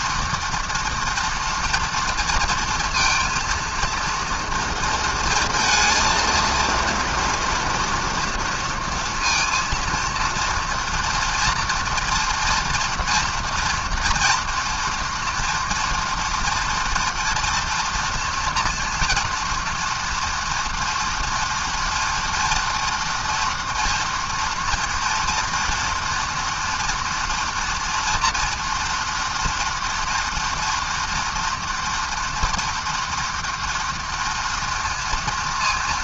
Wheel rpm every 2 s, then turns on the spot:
240, 230, 230, 230, 230, 230, 230, 240, 230, 230, 230, 230, 230, 230, 230, 230, 230, 230.
none